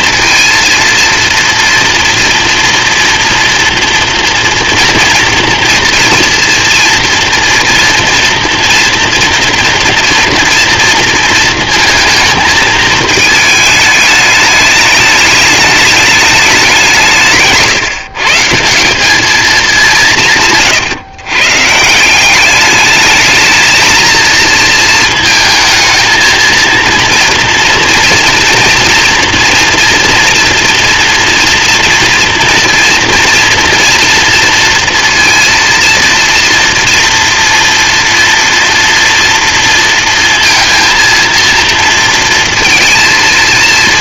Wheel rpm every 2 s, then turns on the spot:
230, 230, 230, 230, 230, 230, 220, 210, 200, 160, 150, 200, 220, 230, 240, 230, 230, 230, 230, 240, 230, 230.
none